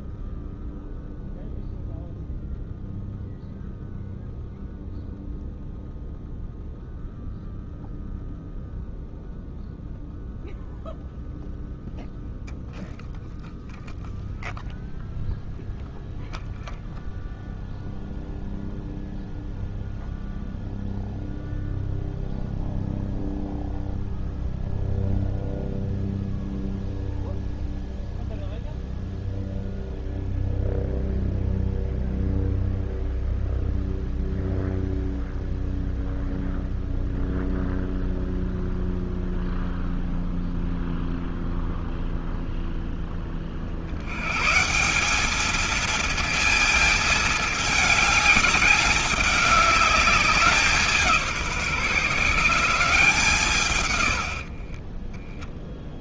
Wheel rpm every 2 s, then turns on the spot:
0, 0, 0, 0, 0, 0, 0, 0, 0, 0, 0, 0, 0, 0, 0, 0, 0, 0, 0, 0, 0, 0, 140, 220, 200, 190, 160, 50.
54-56